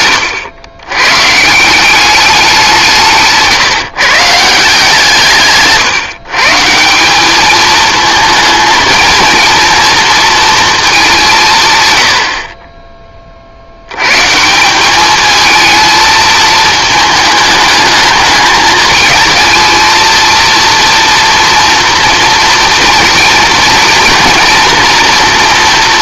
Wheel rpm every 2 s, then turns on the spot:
110, 170, 160, 170, 230, 220, 30, 200, 220, 220, 230, 230, 240.
none